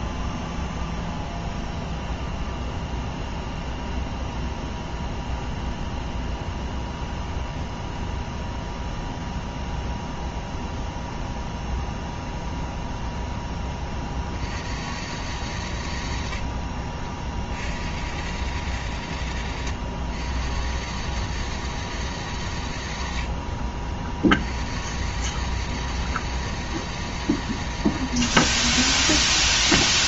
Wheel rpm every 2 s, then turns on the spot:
0, 0, 0, 0, 0, 0, 0, 60, 50, 100, 80, 90, 70, 110, 50.
16-18